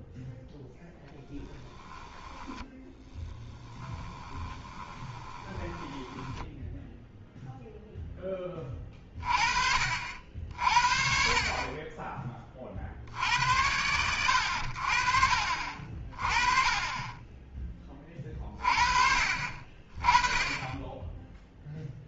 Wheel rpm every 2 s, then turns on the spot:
0, 10, 20, 0, 30, 50, 60, 60, 20, 40, 10.
2-6